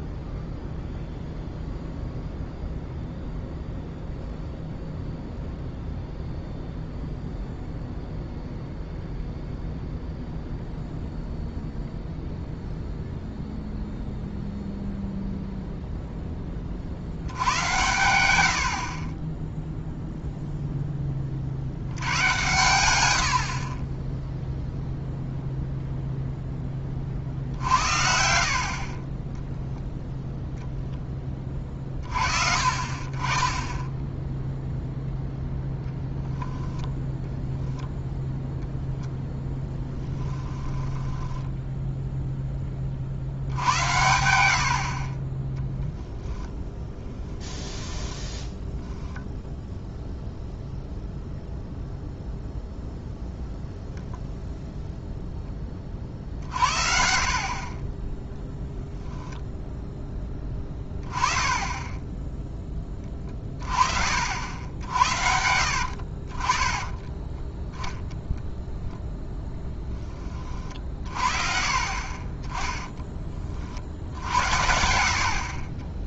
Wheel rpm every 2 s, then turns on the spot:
0, 0, 0, 0, 0, 0, 0, 0, 40, 70, 10, 100, 0, 20, 40, 0, 50, 0, 20, 0, 10, 20, 50, 10, 0, 0, 0, 0, 60, 0, 10, 20, 70, 30, 0, 40, 10, 70.
36-38 40-42 74-76